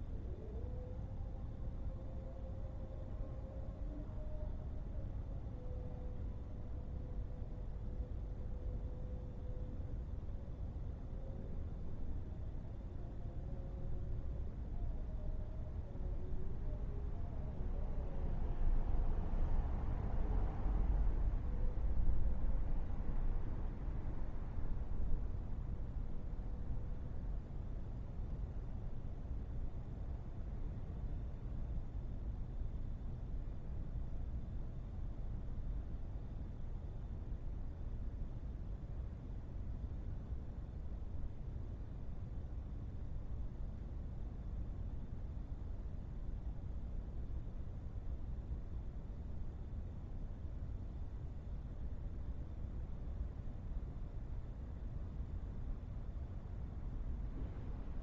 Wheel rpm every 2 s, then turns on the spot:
0, 0, 0, 0, 0, 0, 0, 0, 0, 0, 0, 0, 0, 0, 0, 0, 0, 0, 0, 0, 0, 0, 0, 0, 0, 0, 0, 0, 0.
none